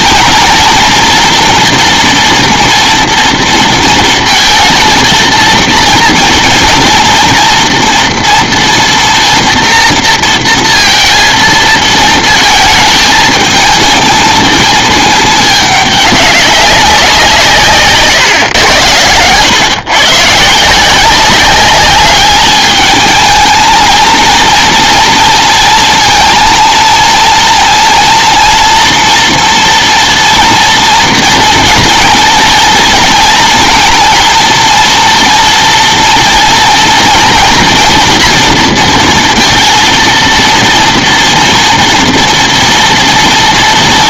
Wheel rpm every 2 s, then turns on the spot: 240, 230, 220, 240, 230, 230, 220, 220, 200, 130, 150, 210, 230, 230, 230, 230, 230, 230, 240, 230, 230, 230.
none